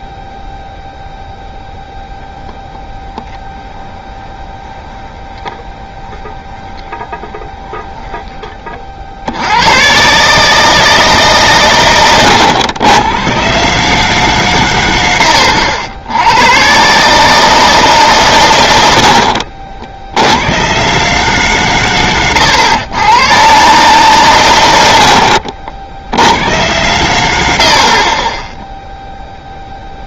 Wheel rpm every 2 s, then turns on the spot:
0, 0, 20, 20, 20, 110, 120, 140, 80, 160, 60, 130, 140, 70, 50.
4-10